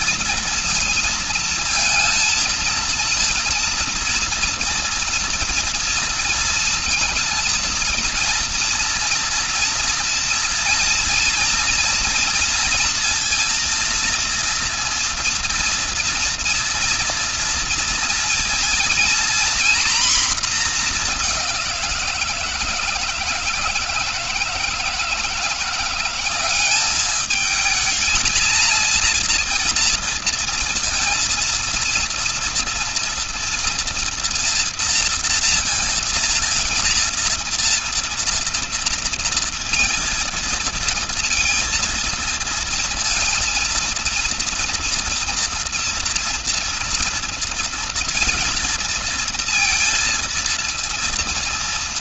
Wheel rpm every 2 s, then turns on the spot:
230, 230, 230, 230, 240, 230, 230, 230, 230, 240, 230, 160, 160, 200, 230, 230, 230, 230, 230, 230, 230, 220, 230, 230, 230, 230.
none